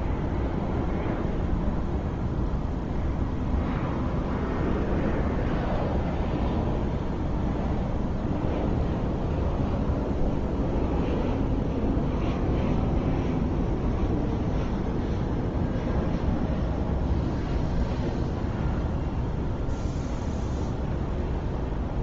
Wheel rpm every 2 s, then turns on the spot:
0, 0, 0, 0, 0, 0, 0, 0, 0, 0, 0.
none